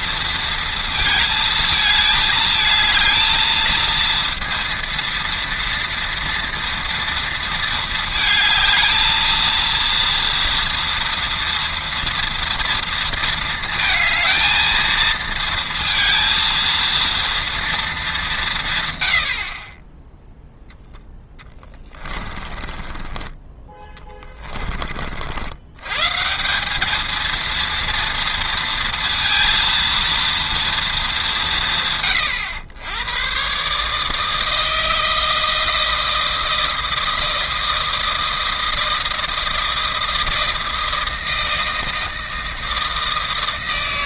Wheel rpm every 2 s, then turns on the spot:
230, 220, 230, 230, 220, 230, 230, 220, 230, 150, 0, 20, 20, 190, 230, 230, 100, 160, 160, 160, 160, 160.
22-24